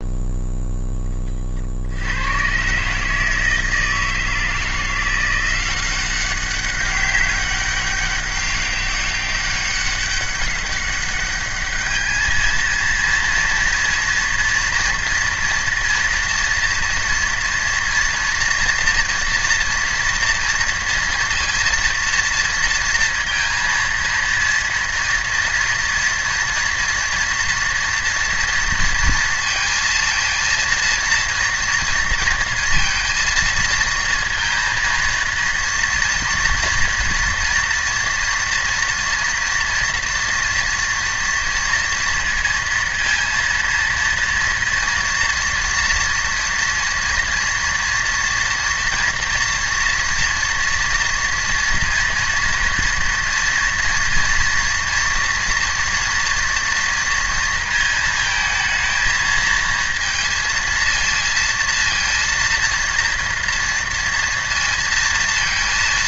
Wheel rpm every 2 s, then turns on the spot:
0, 110, 160, 190, 200, 200, 220, 240, 240, 240, 230, 230, 230, 230, 230, 230, 230, 230, 230, 230, 230, 230, 230, 230, 230, 230, 230, 230, 230, 220, 230, 230, 230.
none